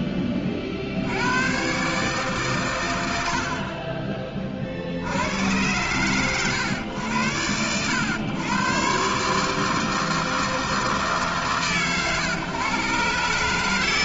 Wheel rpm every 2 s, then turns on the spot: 50, 140, 30, 100, 120, 160, 120.
none